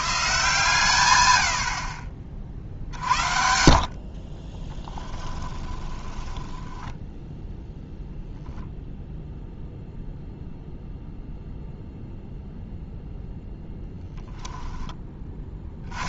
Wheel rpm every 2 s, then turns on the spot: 110, 70, 20, 10, 0, 0, 0, 10.
4-8